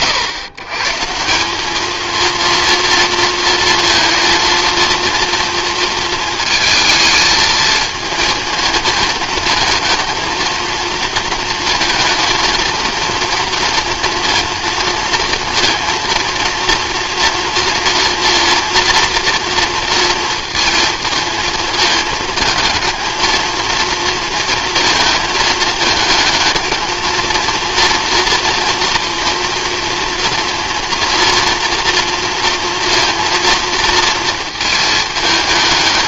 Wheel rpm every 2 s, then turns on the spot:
140, 230, 230, 220, 220, 230, 230, 230, 230, 230, 230, 220, 230, 220, 230, 230, 230, 220.
none